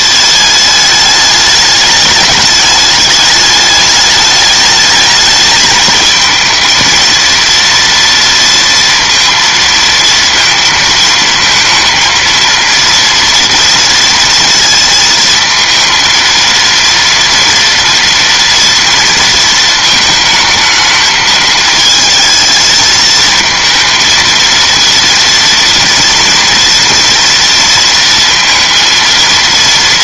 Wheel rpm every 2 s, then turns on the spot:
210, 210, 210, 230, 230, 230, 230, 230, 230, 230, 220, 220, 230, 230, 230.
none